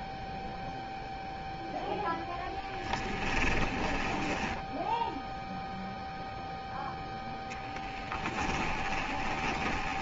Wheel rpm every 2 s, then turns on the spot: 0, 20, 0, 10, 20.
2-4 6-10